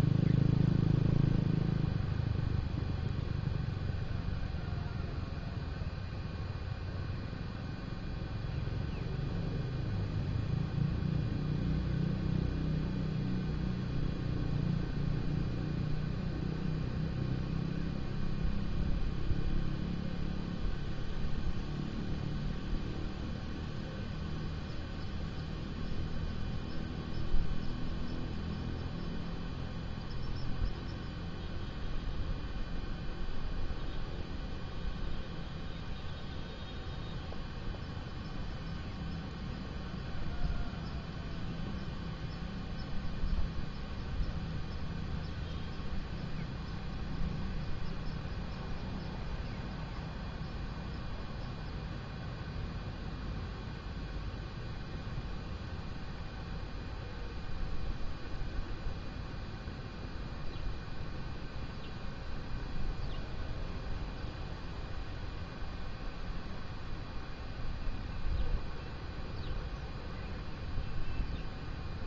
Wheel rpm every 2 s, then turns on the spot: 0, 0, 0, 0, 0, 0, 0, 0, 0, 0, 0, 0, 0, 0, 0, 0, 0, 0, 0, 0, 0, 0, 0, 0, 0, 0, 0, 0, 0, 0, 0, 0, 0, 0, 0, 0.
none